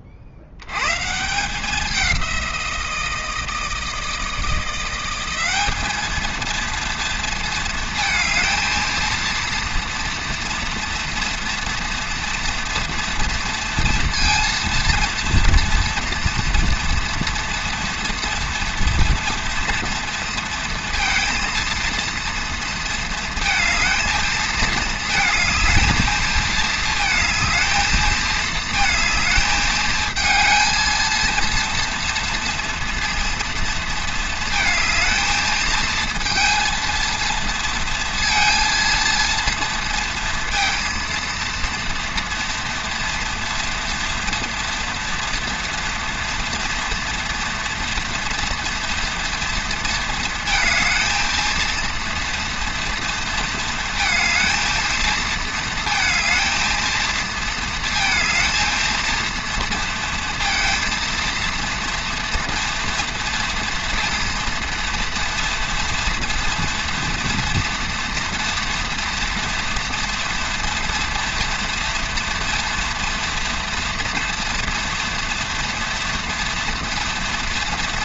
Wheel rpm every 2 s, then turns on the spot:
110, 170, 170, 230, 220, 230, 230, 230, 230, 230, 230, 230, 220, 220, 220, 230, 230, 220, 230, 230, 230, 230, 230, 240, 230, 220, 230, 220, 230, 220, 230, 230, 230, 240, 230, 230, 230, 230, 230.
none